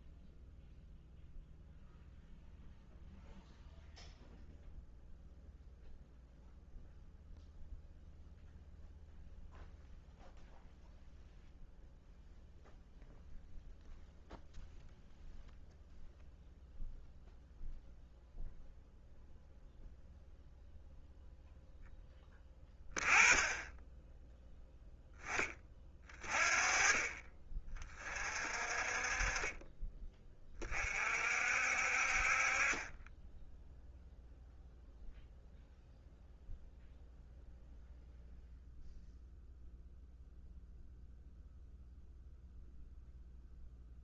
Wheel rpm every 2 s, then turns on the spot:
0, 0, 0, 0, 0, 0, 0, 0, 0, 0, 0, 20, 10, 40, 30, 50, 10, 0, 0, 0, 0, 0.
none